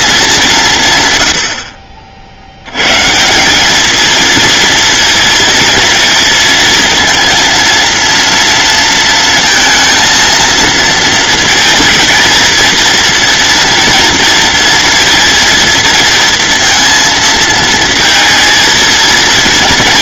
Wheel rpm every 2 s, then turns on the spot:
120, 140, 230, 230, 230, 230, 230, 230, 220, 230.
none